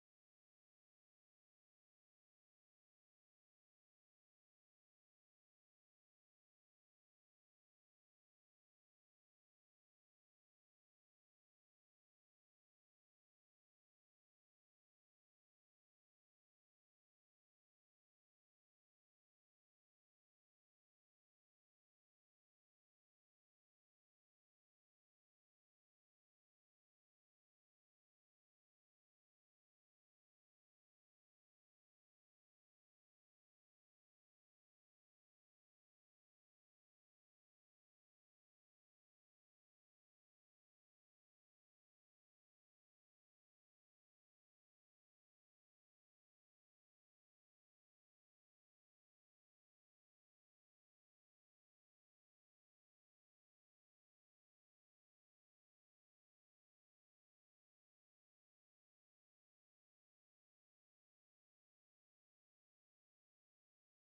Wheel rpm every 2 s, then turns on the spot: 160, 160, 200, 200, 160, 210, 90, 20, 0, 0, 0, 0, 0, 0, 0, 0, 0, 0, 0, 0, 0, 0, 40, 0, 0, 0, 20, 20, 0, 20, 40, 10.
14-16